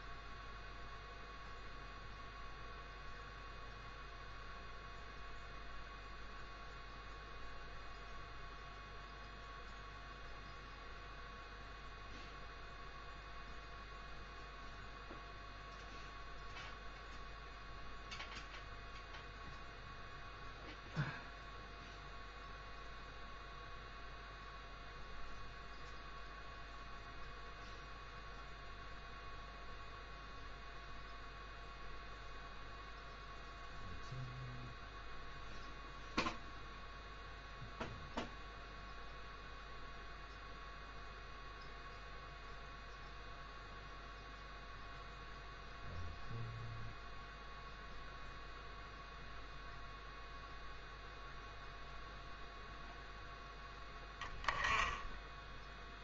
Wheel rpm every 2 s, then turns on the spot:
0, 0, 0, 0, 0, 0, 0, 0, 0, 0, 0, 0, 0, 0, 0, 0, 0, 0, 0, 0, 0, 0, 0, 0, 0, 0, 0, 10.
none